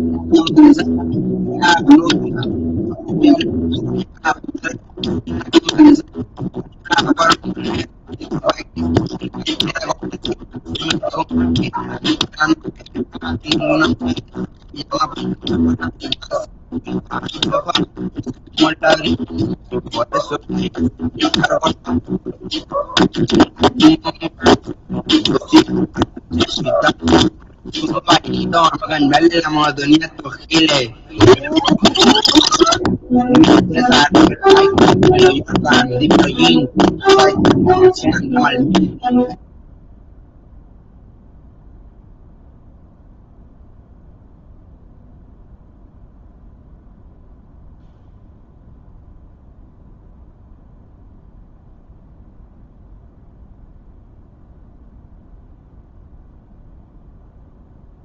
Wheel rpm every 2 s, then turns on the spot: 0, 0, 0, 0, 0, 0, 0, 0, 0, 0, 0, 0, 0, 0, 0, 0, 0, 0, 0, 0, 0, 0, 0, 0, 0, 0, 0, 0, 0.
none